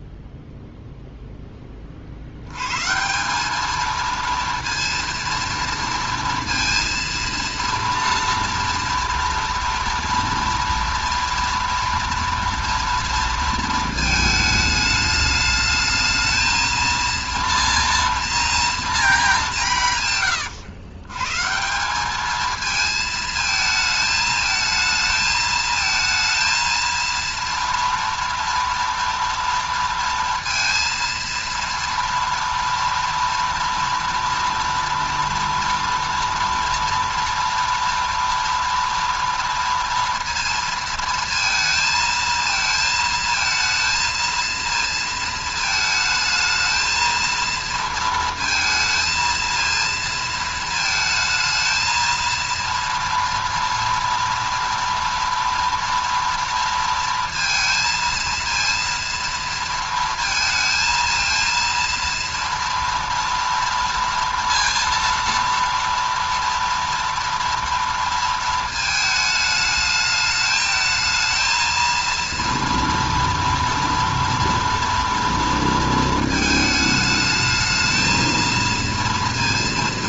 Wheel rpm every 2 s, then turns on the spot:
0, 110, 230, 230, 230, 230, 230, 220, 220, 230, 110, 220, 220, 230, 230, 230, 230, 230, 230, 230, 230, 220, 230, 220, 220, 230, 230, 230, 230, 230, 220, 230, 230, 230, 220, 220, 230, 230, 220, 230.
none